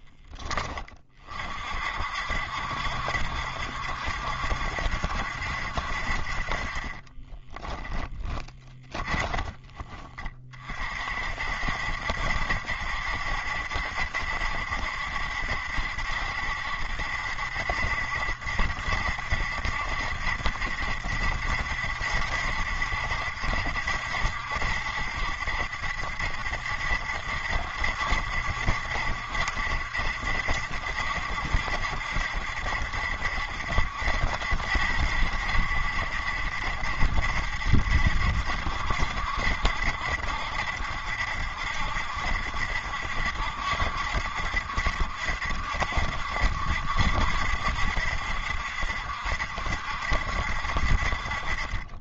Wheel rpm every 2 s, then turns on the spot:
20, 60, 70, 30, 20, 40, 70, 70, 70, 70, 70, 70, 70, 70, 70, 70, 70, 70, 70, 70, 70, 70, 70, 70, 70, 60.
8-10